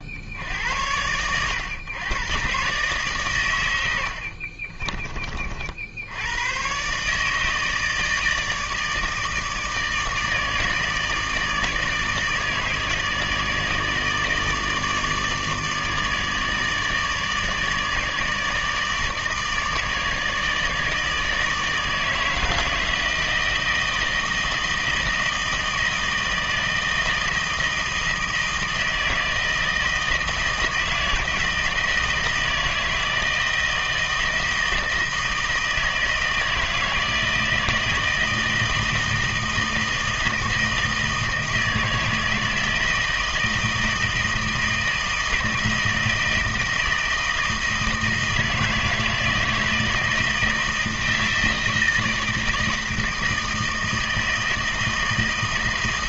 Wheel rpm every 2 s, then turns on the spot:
80, 130, 50, 110, 160, 160, 160, 160, 150, 150, 150, 160, 160, 160, 160, 160, 160, 160, 160, 160, 160, 160, 160, 160, 160, 160, 160, 160.
4-6